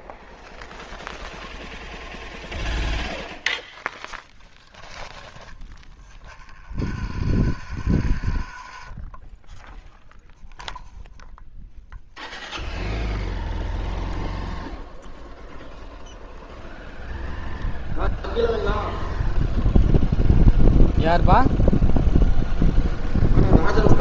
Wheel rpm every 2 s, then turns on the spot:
0, 0, 0, 40, 30, 0, 0, 0, 0, 0, 0, 0.
6-10